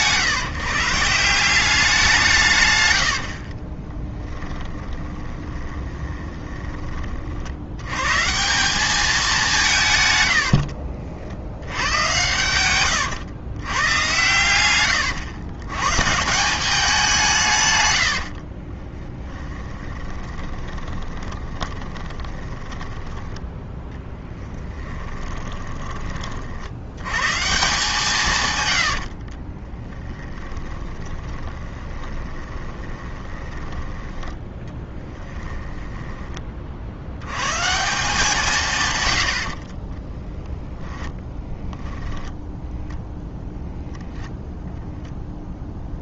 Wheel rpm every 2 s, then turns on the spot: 160, 110, 10, 30, 190, 60, 110, 110, 190, 40, 20, 10, 10, 80, 110, 20, 20, 20, 50, 120, 10, 0, 0.
4-6 10-12 18-26 28-36